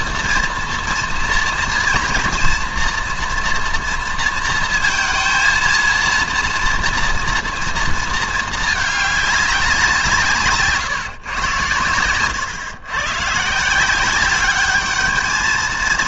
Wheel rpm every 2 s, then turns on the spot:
230, 230, 230, 240, 210, 140, 120, 210.
none